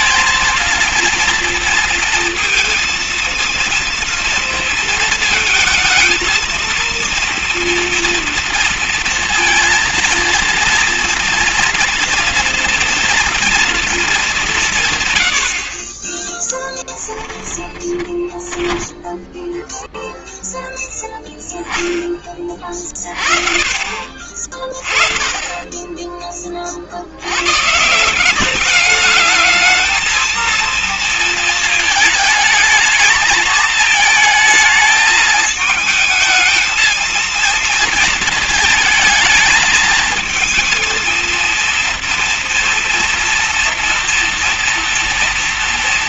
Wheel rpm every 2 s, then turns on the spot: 230, 230, 230, 230, 230, 230, 230, 200, 10, 20, 0, 30, 40, 30, 190, 230, 220, 220, 220, 220, 220, 230, 230.
16-20